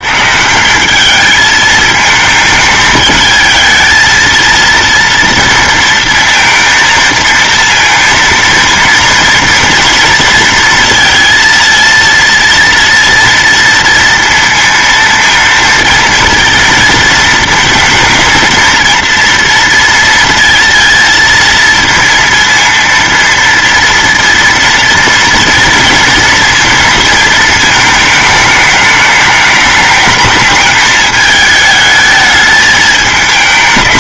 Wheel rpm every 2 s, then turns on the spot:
170, 220, 230, 220, 230, 230, 230, 230, 230, 230, 230, 230, 240, 230, 210, 220, 220.
none